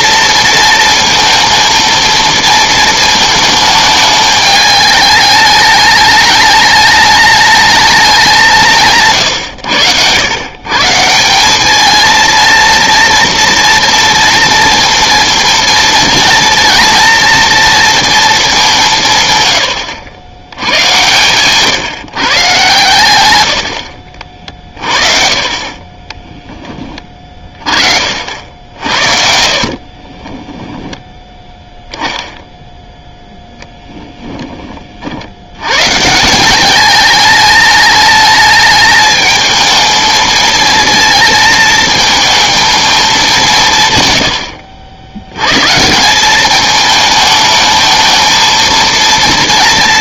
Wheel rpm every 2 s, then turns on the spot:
230, 230, 210, 210, 180, 140, 230, 230, 230, 190, 90, 130, 40, 10, 60, 10, 0, 30, 200, 210, 220, 220, 80, 210, 230.
30-32